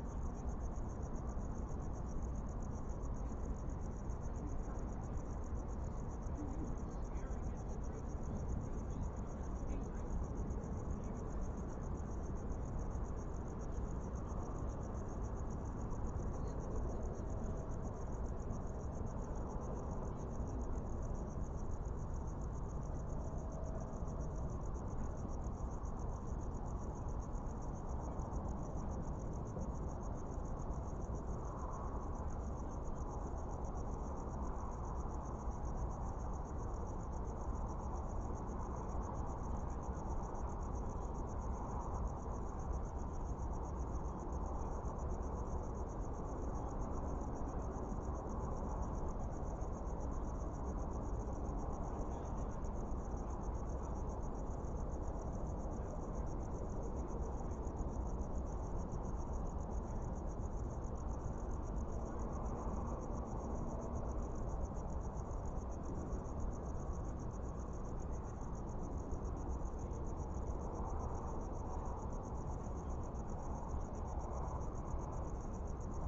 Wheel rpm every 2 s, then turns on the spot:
0, 0, 0, 0, 0, 0, 0, 0, 0, 0, 0, 0, 0, 0, 0, 0, 0, 0, 0, 0, 0, 0, 0, 0, 0, 0, 0, 0, 0, 0, 0, 0, 0, 0, 0, 0, 0, 0.
none